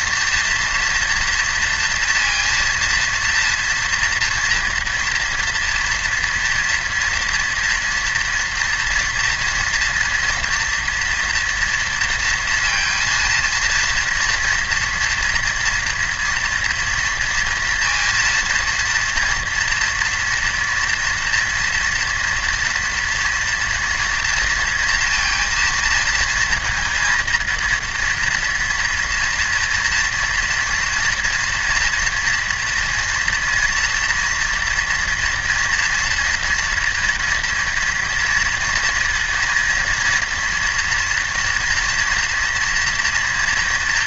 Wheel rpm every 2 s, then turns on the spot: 230, 230, 230, 230, 230, 240, 230, 240, 230, 230, 230, 240, 230, 230, 230, 230, 230, 230, 230, 240, 230, 230.
none